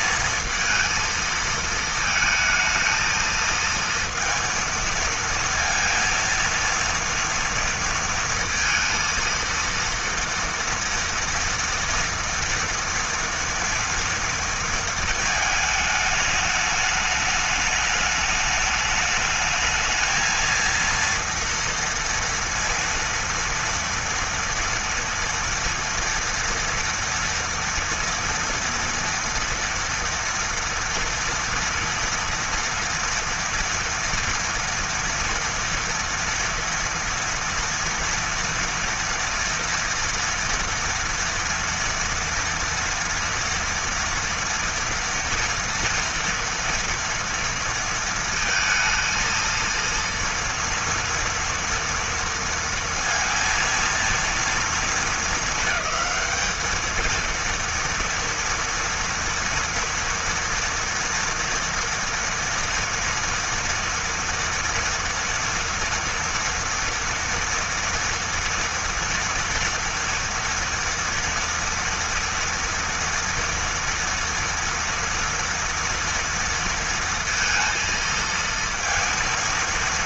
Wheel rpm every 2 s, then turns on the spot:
230, 220, 230, 230, 230, 230, 240, 220, 210, 210, 230, 230, 230, 230, 230, 230, 230, 230, 230, 230, 240, 230, 230, 230, 230, 230, 230, 220, 230, 230, 230, 230, 230, 230, 230, 230, 230, 230, 230, 230.
none